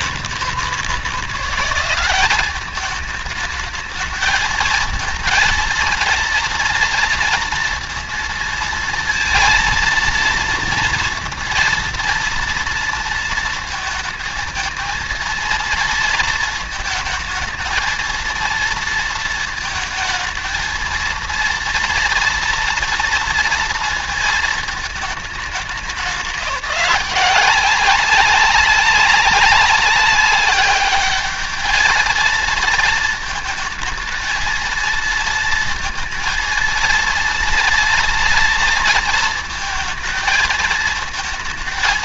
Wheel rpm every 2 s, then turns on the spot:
160, 200, 220, 230, 230, 230, 230, 230, 230, 230, 220, 230, 220, 170, 190, 200, 220, 220, 230, 230, 230.
none